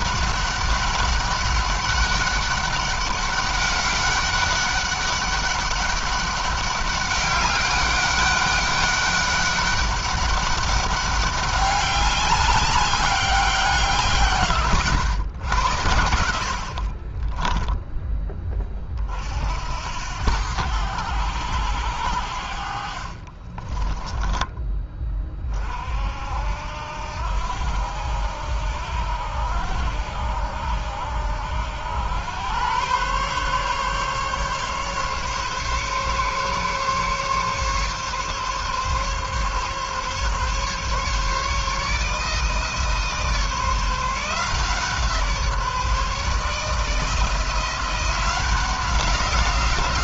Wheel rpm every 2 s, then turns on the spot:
200, 200, 200, 200, 200, 200, 200, 110, 50, 40, 90, 50, 30, 70, 80, 80, 120, 140, 140, 140, 140, 160, 160, 160, 180.
16-18 22-24